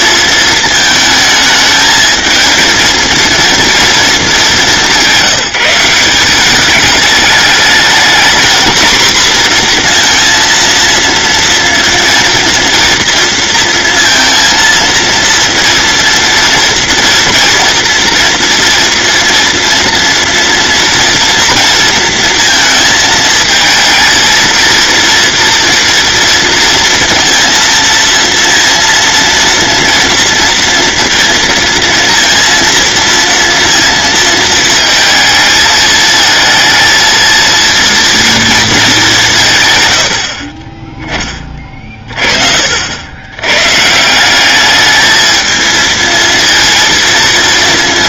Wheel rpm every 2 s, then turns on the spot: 220, 230, 180, 210, 240, 230, 230, 230, 230, 230, 230, 220, 230, 230, 230, 230, 230, 220, 220, 200, 10, 80, 210, 230.
none